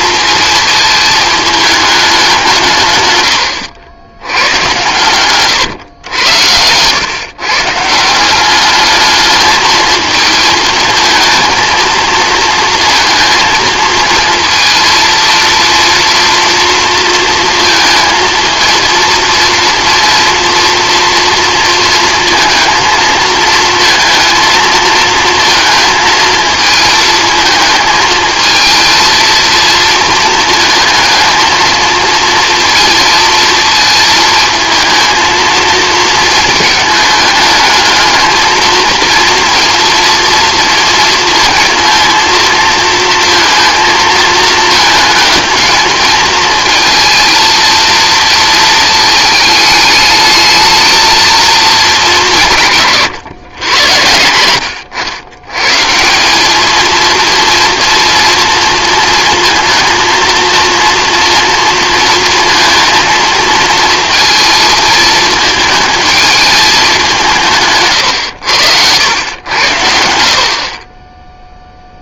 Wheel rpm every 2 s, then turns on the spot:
220, 150, 130, 110, 200, 220, 230, 230, 230, 230, 230, 230, 230, 220, 220, 230, 230, 220, 220, 220, 230, 230, 220, 220, 220, 220, 160, 90, 220, 230, 230, 230, 220, 210, 90, 40.
none